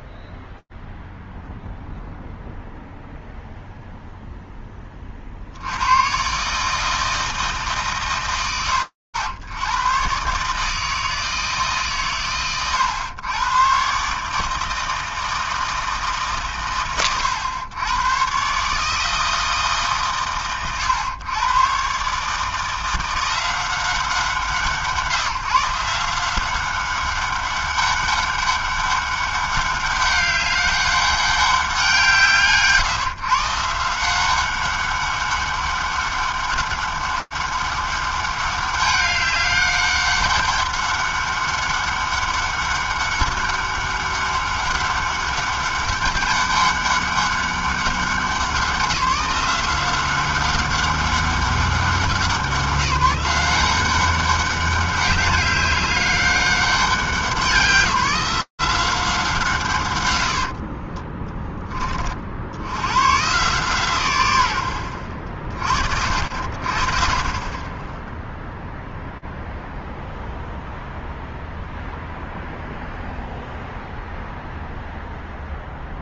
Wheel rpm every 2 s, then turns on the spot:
0, 0, 0, 80, 130, 120, 110, 130, 150, 100, 120, 130, 160, 170, 200, 200, 180, 160, 200, 200, 200, 200, 200, 200, 190, 180, 190, 180, 200, 190, 160, 20, 130, 60, 20, 0, 0, 0.
none